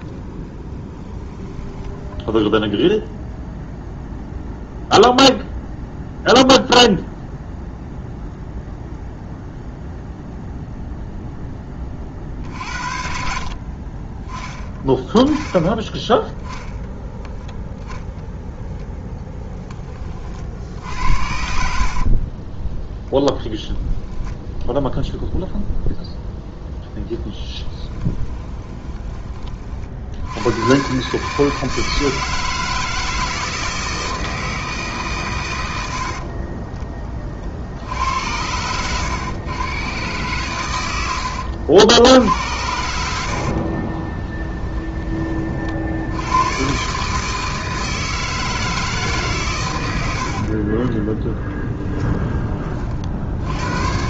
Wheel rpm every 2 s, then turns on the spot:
10, 0, 0, 0, 0, 0, 50, 10, 10, 10, 60, 10, 0, 0, 20, 110, 160, 150, 30, 100, 110, 80, 10, 130, 160, 30, 30.
0-2 28-30